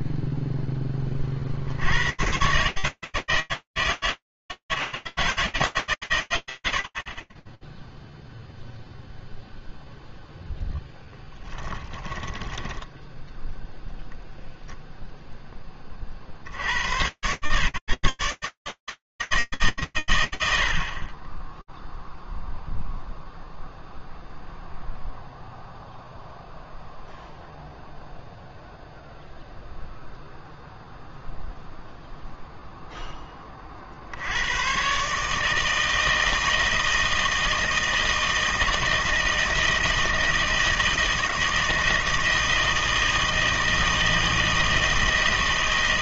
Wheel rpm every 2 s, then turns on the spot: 10, 140, 160, 130, 0, 0, 10, 0, 90, 140, 120, 0, 0, 0, 0, 0, 20, 150, 160, 160, 160, 160, 160.
12-14